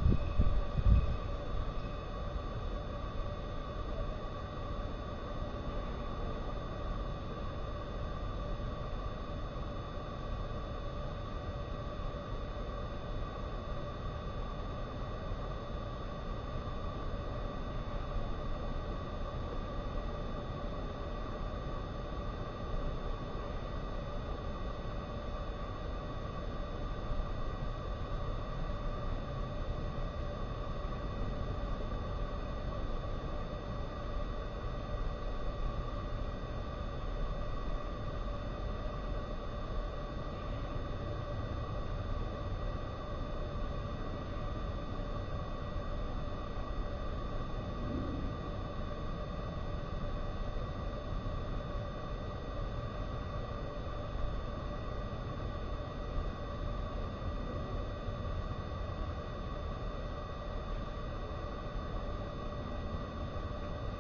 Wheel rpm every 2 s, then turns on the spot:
0, 0, 0, 0, 0, 0, 0, 0, 0, 0, 0, 0, 0, 0, 0, 0, 0, 0, 0, 0, 0, 0, 0, 0, 0, 0, 0, 0, 0, 0, 0, 0.
none